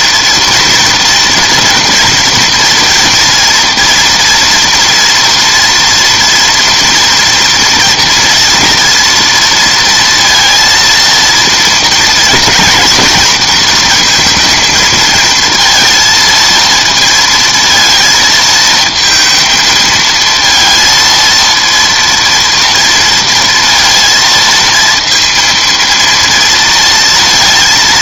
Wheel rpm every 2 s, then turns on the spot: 230, 240, 240, 230, 230, 230, 230, 230, 230, 220, 230, 230, 230, 230.
none